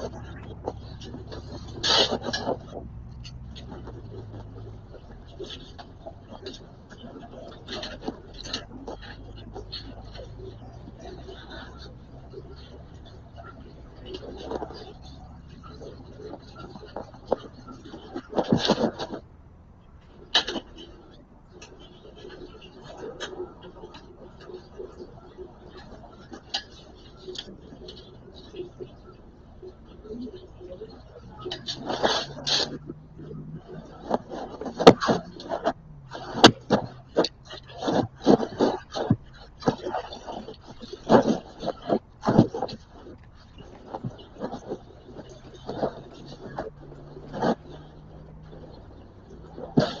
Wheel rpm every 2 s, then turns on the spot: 0, 0, 0, 0, 0, 0, 0, 0, 0, 0, 0, 0, 0, 0, 0, 0, 0, 0, 0, 0, 0, 0, 0, 0, 0.
none